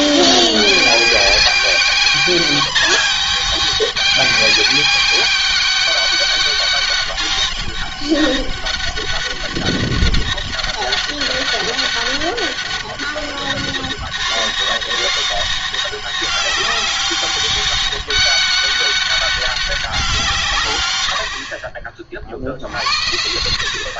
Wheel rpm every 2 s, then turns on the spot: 200, 210, 200, 200, 200, 200, 200, 200, 190, 200, 150, 60.
none